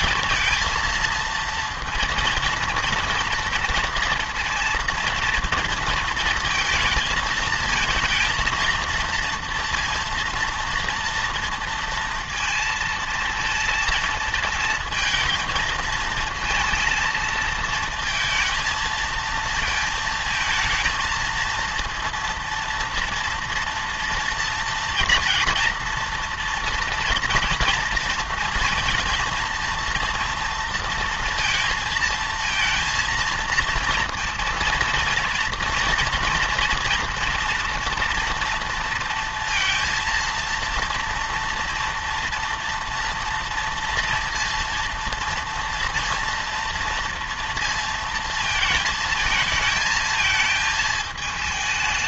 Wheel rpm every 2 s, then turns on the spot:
230, 230, 230, 230, 230, 230, 230, 220, 220, 230, 220, 230, 230, 230, 230, 230, 220, 230, 230, 230, 230, 230, 230, 230, 220, 220.
none